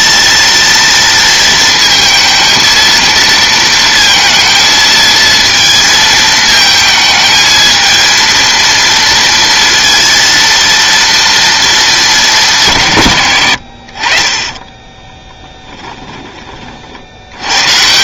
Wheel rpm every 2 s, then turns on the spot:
230, 230, 220, 220, 230, 230, 150, 20, 60.
14-16